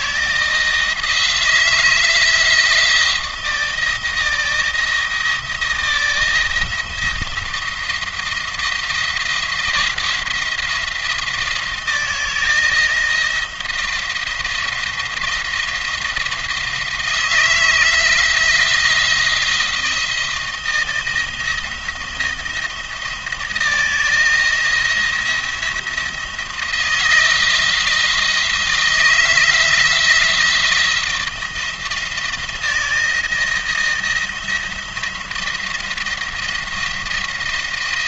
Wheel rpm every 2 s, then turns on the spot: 160, 170, 160, 160, 170, 170, 170, 170, 160, 170, 170, 170, 170, 170, 170, 170, 170, 170, 170.
none